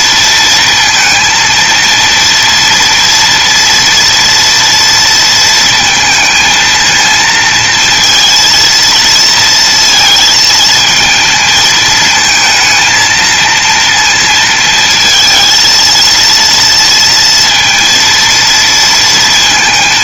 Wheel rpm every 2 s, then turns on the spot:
230, 230, 230, 230, 230, 220, 230, 230, 230, 230.
none